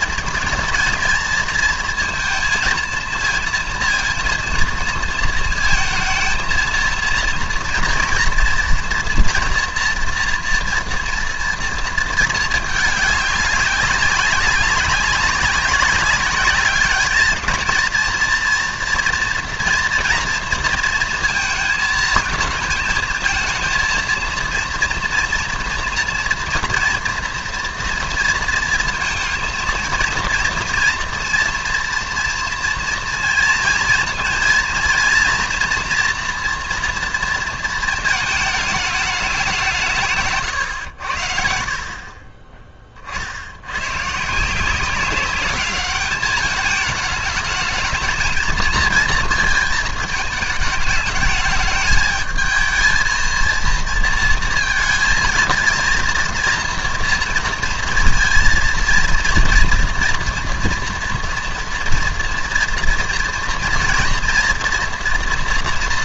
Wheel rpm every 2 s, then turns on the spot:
230, 230, 230, 230, 230, 230, 210, 200, 210, 230, 240, 220, 230, 230, 230, 230, 230, 230, 230, 220, 120, 20, 170, 210, 220, 210, 220, 220, 230, 230, 230, 230, 230.
none